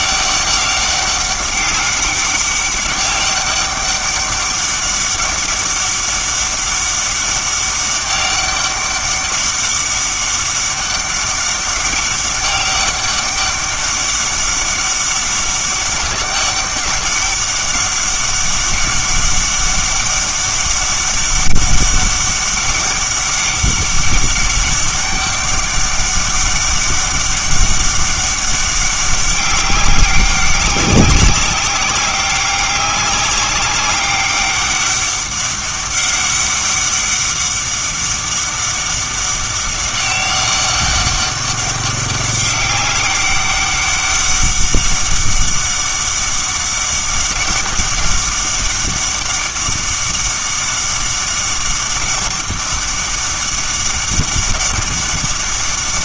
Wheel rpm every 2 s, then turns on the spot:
200, 200, 200, 200, 200, 200, 200, 200, 200, 200, 200, 200, 200, 200, 200, 200, 190, 200, 200, 200, 200, 190, 200, 200, 200, 200, 200, 200.
none